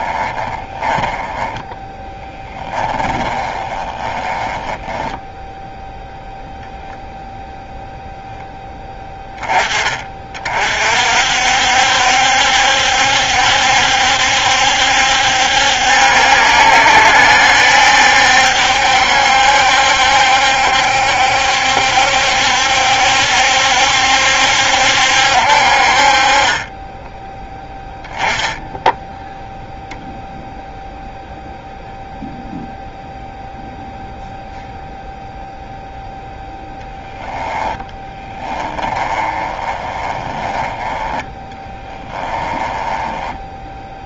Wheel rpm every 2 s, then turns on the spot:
20, 10, 10, 0, 10, 40, 70, 70, 70, 70, 70, 70, 70, 30, 10, 0, 0, 0, 0, 10, 10, 20.
0-6 38-44